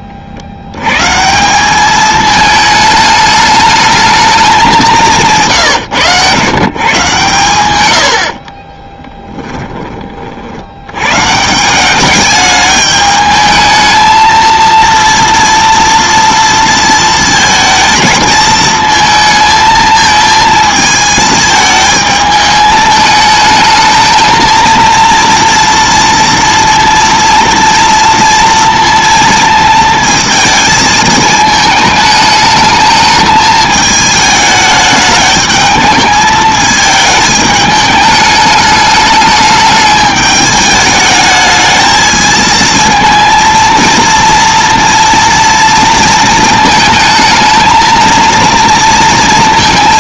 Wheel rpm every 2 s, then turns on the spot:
80, 220, 200, 130, 30, 70, 210, 230, 230, 220, 220, 220, 230, 230, 230, 220, 220, 210, 220, 210, 210, 230, 230, 220, 230.
8-10